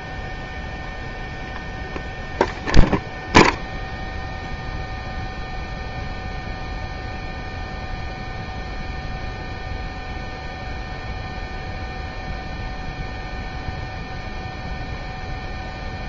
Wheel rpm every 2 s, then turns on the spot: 0, 0, 0, 0, 0, 0, 0, 0.
none